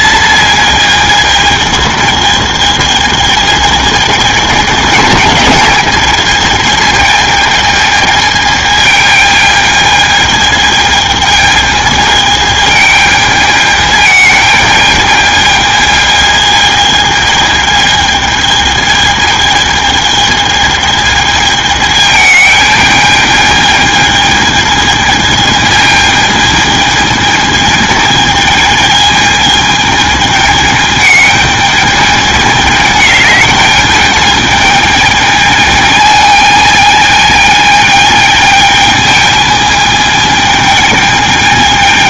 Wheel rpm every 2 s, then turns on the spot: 220, 220, 220, 220, 210, 220, 210, 210, 220, 220, 220, 220, 220, 220, 220, 220, 210, 210, 220, 220, 220.
none